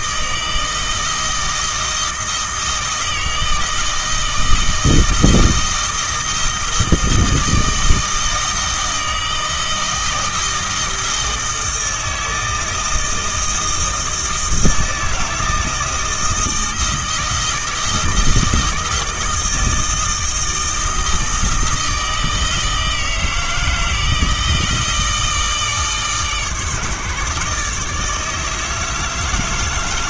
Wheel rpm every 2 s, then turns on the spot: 160, 160, 160, 160, 160, 160, 160, 160, 160, 160, 160, 160, 160, 150, 160.
none